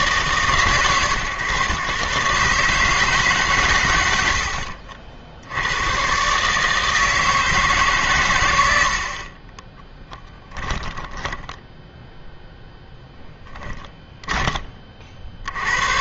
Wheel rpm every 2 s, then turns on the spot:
130, 150, 60, 160, 80, 10, 0, 20.
10-12